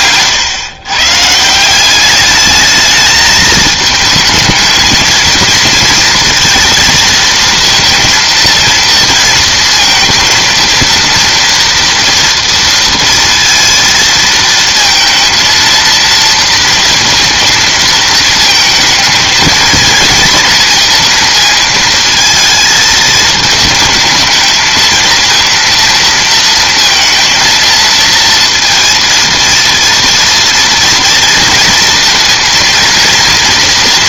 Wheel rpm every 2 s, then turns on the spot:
120, 210, 220, 230, 230, 230, 230, 230, 230, 220, 230, 220, 220, 230, 230, 230, 230.
none